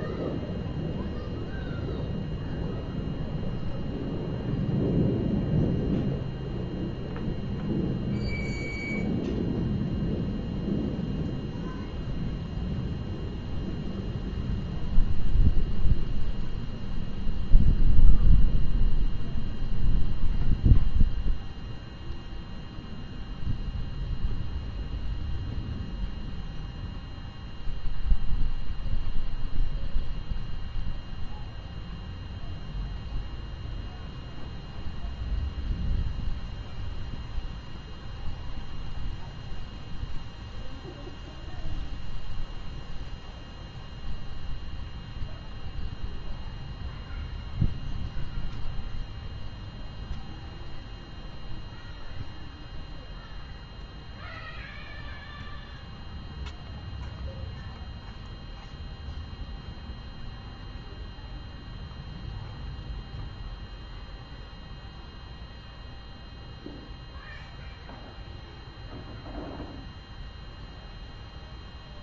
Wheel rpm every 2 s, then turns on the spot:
0, 0, 0, 0, 0, 0, 0, 0, 0, 0, 0, 0, 0, 0, 0, 0, 0, 0, 0, 0, 0, 0, 0, 0, 0, 0, 0, 0, 0, 0, 0, 0, 0, 0, 0, 0.
none